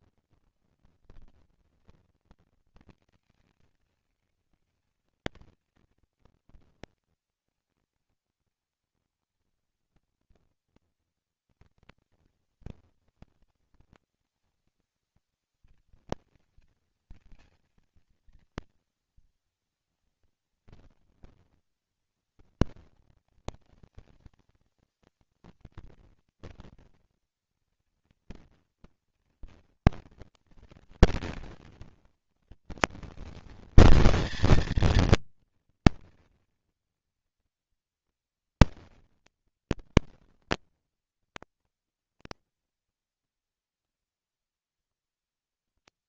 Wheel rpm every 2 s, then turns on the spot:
180, 210, 210, 220, 230, 240, 220, 230, 220, 210, 220, 210, 230, 230, 230, 230, 230, 230, 230, 230, 230, 230, 230.
none